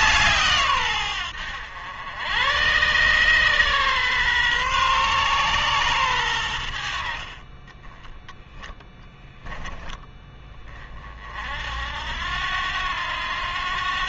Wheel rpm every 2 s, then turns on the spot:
120, 130, 130, 60, 10, 40, 90.
none